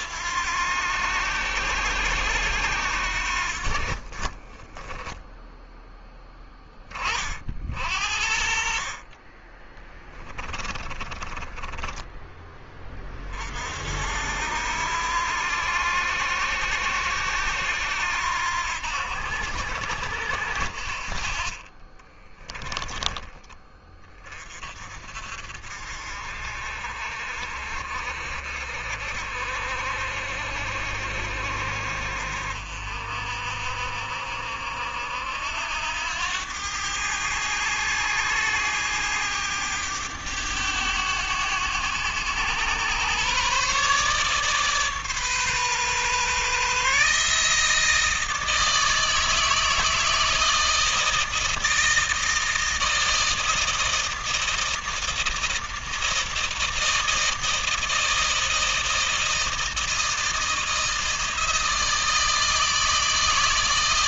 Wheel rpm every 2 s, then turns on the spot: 90, 80, 20, 10, 50, 20, 20, 70, 80, 80, 70, 20, 30, 50, 50, 60, 60, 70, 100, 100, 100, 110, 140, 140, 160, 160, 160, 160, 160, 160, 160, 160.
4-6 10-12 22-24